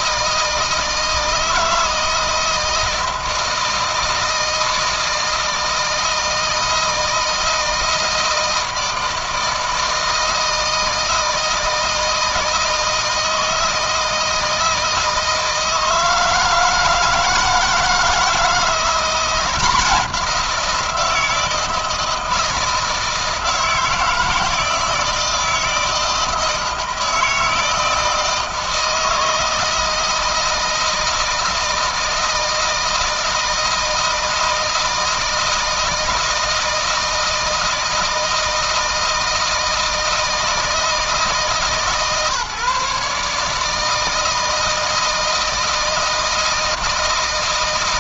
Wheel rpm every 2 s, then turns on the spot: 160, 170, 160, 160, 160, 160, 160, 160, 160, 170, 170, 160, 160, 160, 160, 160, 160, 160, 160, 160, 160, 150, 160, 160.
none